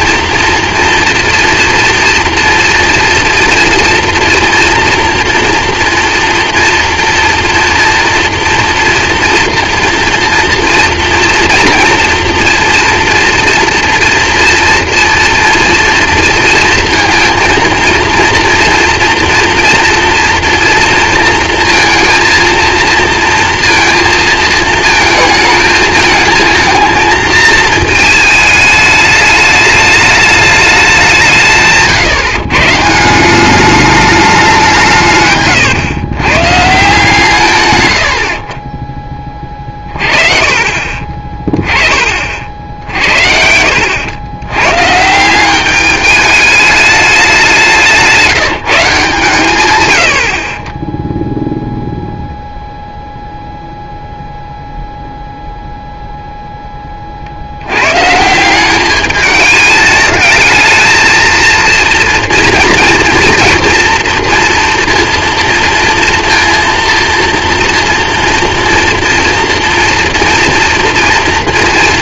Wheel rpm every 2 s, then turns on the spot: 230, 230, 230, 230, 230, 230, 230, 230, 230, 230, 230, 230, 220, 220, 220, 200, 150, 180, 140, 40, 40, 60, 100, 210, 170, 30, 0, 0, 10, 180, 220, 230, 230, 230, 230, 230.
40-42